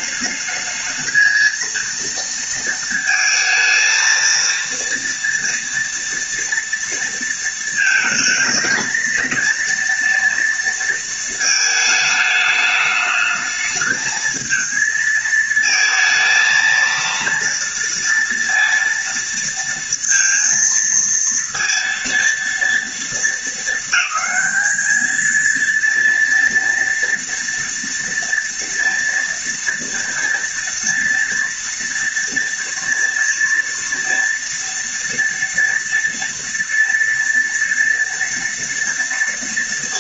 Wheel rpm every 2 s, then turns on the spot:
220, 230, 230, 230, 230, 230, 210, 220, 230, 230, 230, 230, 220, 230, 230, 230, 230, 230, 230, 230.
none